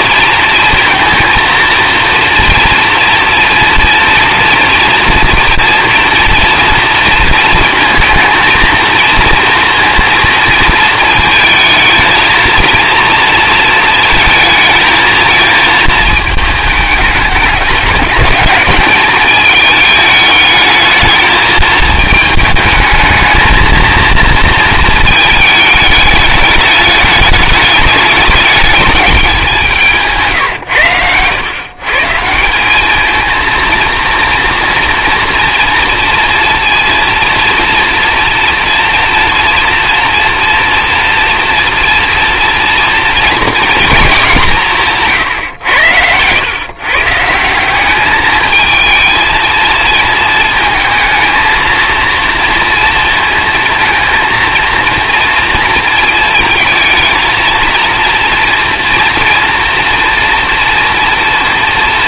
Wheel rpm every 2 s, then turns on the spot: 230, 230, 230, 230, 220, 230, 230, 230, 220, 200, 210, 220, 230, 210, 210, 130, 180, 230, 230, 240, 230, 230, 180, 120, 220, 220, 230, 230, 220, 230, 230.
30-32